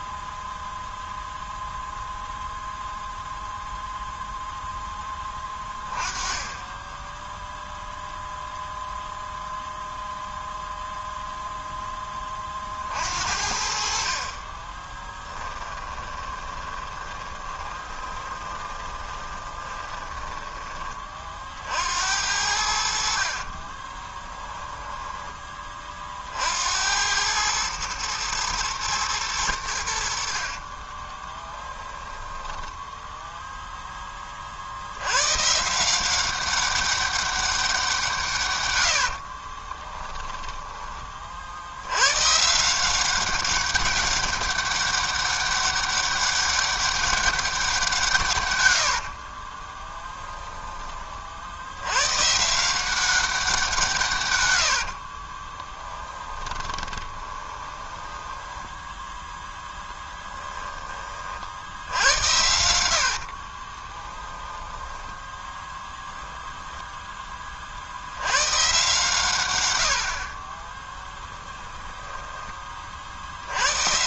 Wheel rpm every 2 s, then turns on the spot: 0, 0, 10, 10, 0, 0, 40, 20, 20, 20, 20, 70, 10, 70, 110, 40, 10, 70, 200, 110, 20, 170, 200, 200, 90, 20, 170, 80, 20, 10, 30, 70, 10, 0, 130, 10, 40.
14-20 24-26 30-34 38-40 48-50 54-60 62-64